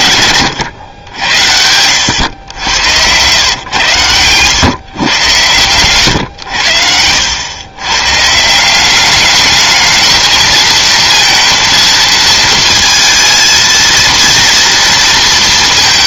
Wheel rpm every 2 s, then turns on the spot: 120, 100, 120, 100, 170, 220, 230, 230.
2-4